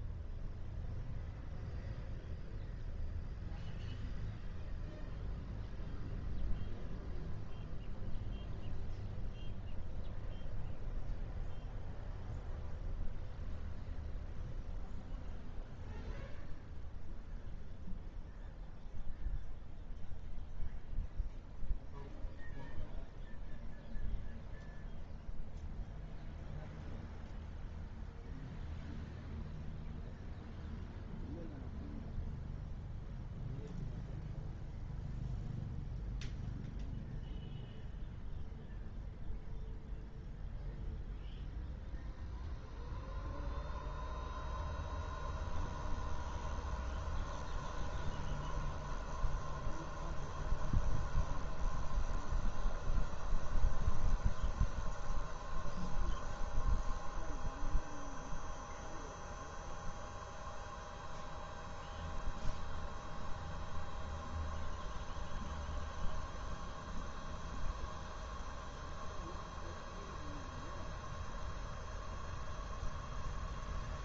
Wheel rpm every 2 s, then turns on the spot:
0, 0, 0, 0, 0, 0, 0, 0, 0, 0, 0, 0, 0, 0, 0, 0, 0, 0, 0, 0, 0, 0, 0, 0, 0, 0, 0, 0, 0, 0, 0, 0, 0, 0, 0, 0, 0.
none